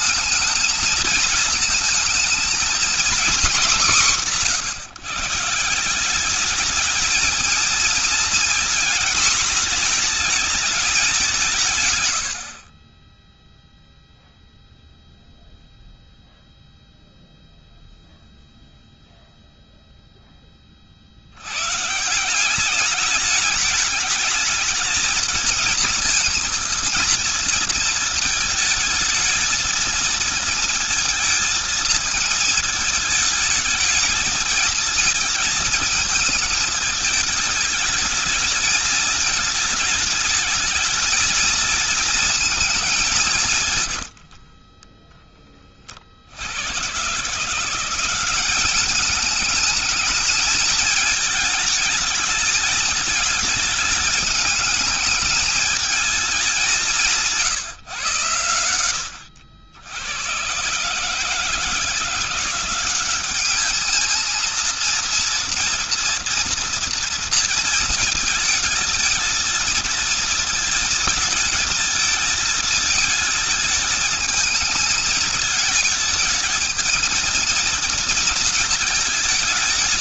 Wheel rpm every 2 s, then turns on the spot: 220, 230, 180, 200, 230, 220, 60, 0, 0, 0, 20, 180, 220, 230, 220, 230, 220, 220, 220, 220, 220, 220, 60, 80, 190, 220, 210, 210, 200, 110, 130, 180, 220, 240, 230, 230, 220, 220, 220, 230.
44-46